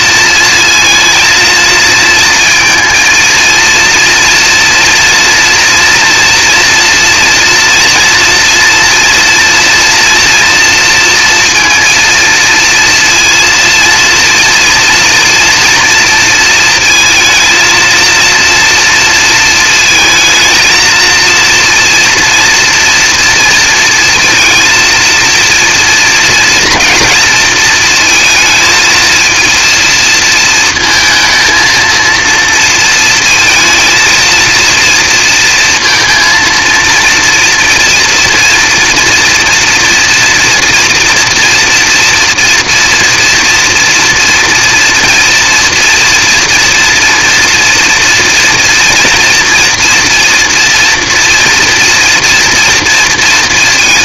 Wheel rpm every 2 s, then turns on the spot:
220, 230, 230, 230, 230, 230, 230, 240, 230, 230, 230, 240, 230, 230, 220, 220, 220, 220, 230, 230, 230, 230, 230, 230, 230, 230, 240.
none